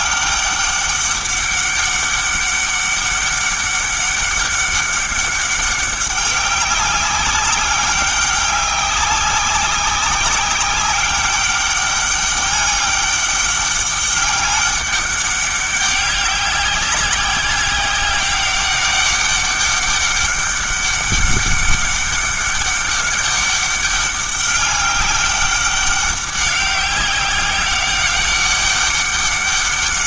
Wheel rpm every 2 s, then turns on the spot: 200, 200, 200, 200, 190, 200, 200, 200, 190, 200, 200, 200, 200, 190, 200.
none